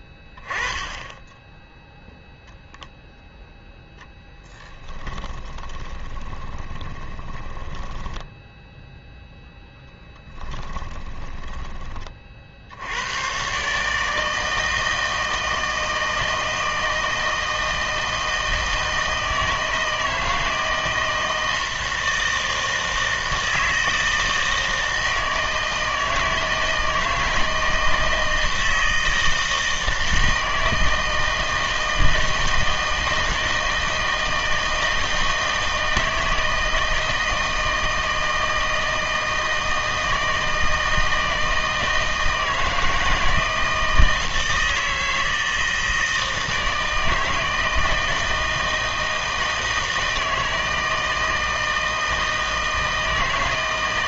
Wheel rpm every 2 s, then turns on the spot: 20, 0, 10, 30, 0, 10, 80, 160, 160, 160, 160, 160, 160, 160, 160, 160, 160, 160, 160, 160, 160, 160, 160, 160, 160, 160, 160.
4-8 10-12